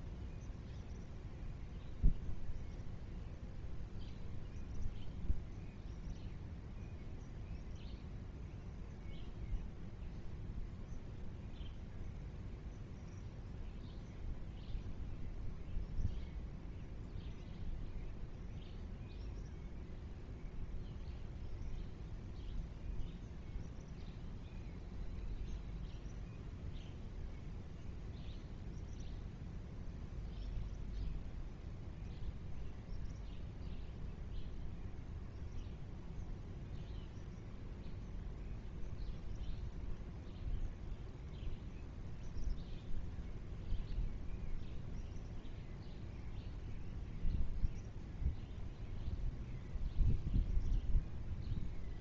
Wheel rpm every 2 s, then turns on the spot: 0, 0, 0, 0, 0, 0, 0, 0, 0, 0, 0, 0, 0, 0, 0, 0, 0, 0, 0, 0, 0, 0, 0, 0, 0, 0.
none